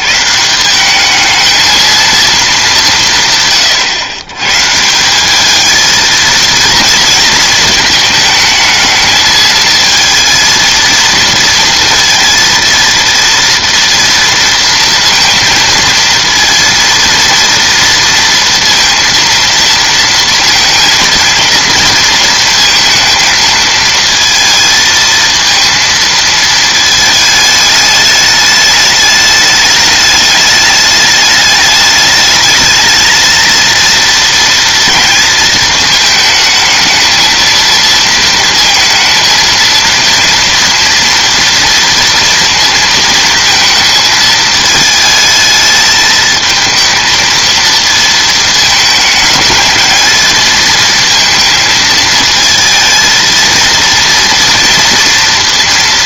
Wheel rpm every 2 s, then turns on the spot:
100, 220, 120, 230, 220, 230, 230, 230, 220, 230, 230, 230, 220, 220, 210, 210, 210, 230, 220, 230, 230, 230, 220, 220, 220, 220, 230, 230.
none